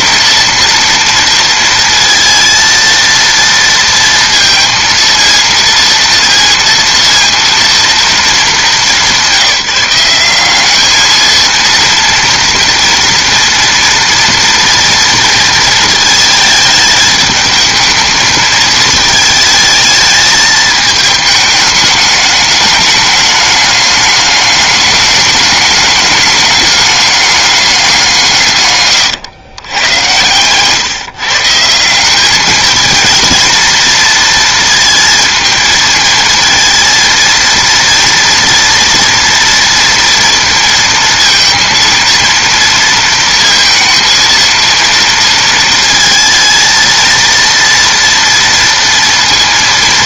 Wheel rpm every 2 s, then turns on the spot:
230, 230, 230, 230, 200, 210, 230, 230, 220, 220, 220, 210, 210, 210, 130, 140, 220, 230, 230, 230, 230, 230, 230, 230, 230.
none